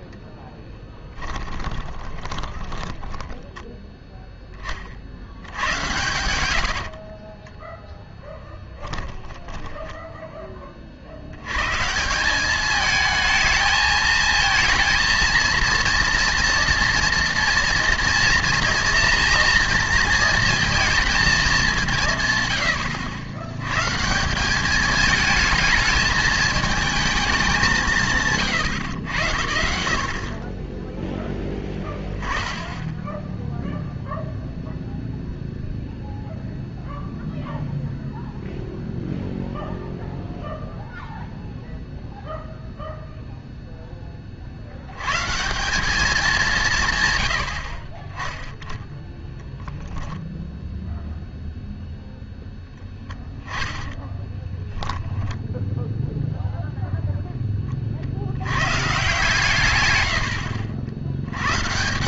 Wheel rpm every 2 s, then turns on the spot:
10, 20, 40, 60, 10, 30, 210, 230, 230, 230, 230, 90, 200, 220, 120, 10, 10, 0, 0, 0, 0, 0, 90, 150, 10, 0, 0, 10, 0, 130, 70.
0-4 6-10 54-56